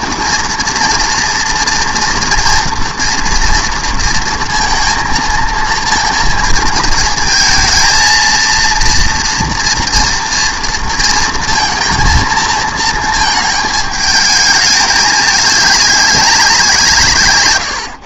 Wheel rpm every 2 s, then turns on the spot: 230, 230, 230, 230, 230, 230, 220, 210, 180.
none